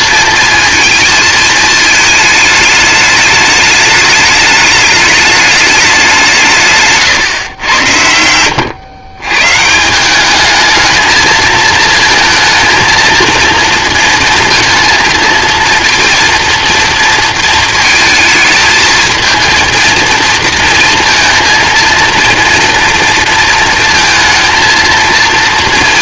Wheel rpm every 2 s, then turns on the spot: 230, 210, 210, 140, 120, 220, 230, 230, 230, 220, 230, 230, 230.
none